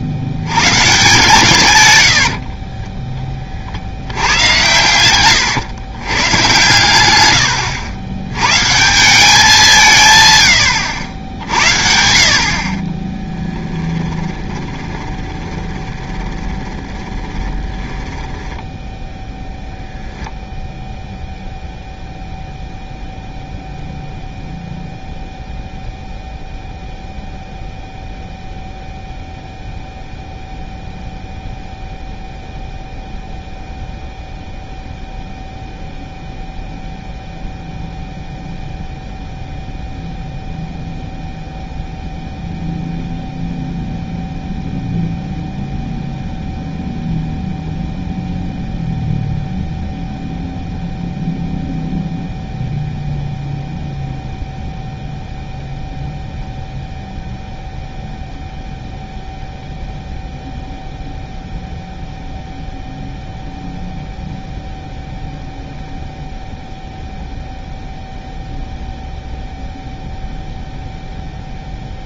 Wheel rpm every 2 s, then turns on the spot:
120, 20, 110, 110, 150, 100, 40, 20, 20, 10, 0, 0, 0, 0, 0, 0, 0, 0, 0, 0, 0, 0, 0, 0, 0, 0, 0, 0, 0, 0, 0, 0, 0, 0, 0, 0.
2-6 14-18